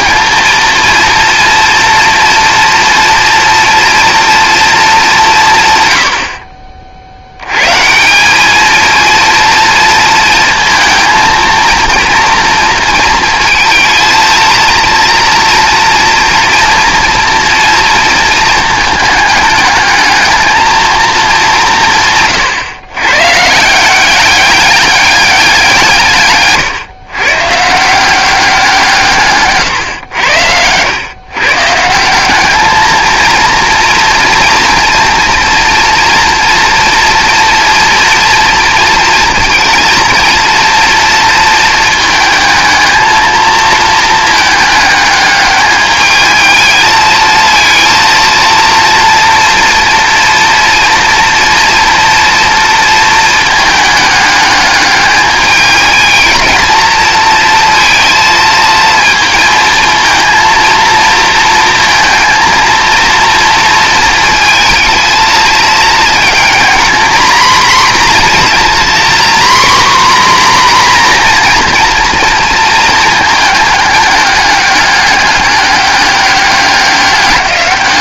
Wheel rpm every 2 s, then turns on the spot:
230, 230, 220, 50, 220, 230, 230, 230, 230, 220, 230, 120, 200, 130, 180, 100, 210, 230, 240, 230, 230, 220, 210, 220, 230, 230, 230, 210, 220, 230, 230, 230, 230, 230, 250, 250, 230, 210, 200.
none